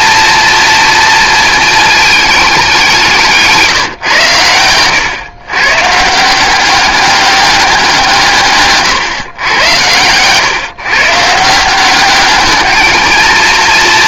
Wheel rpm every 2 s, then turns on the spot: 230, 200, 120, 200, 140, 140, 220.
none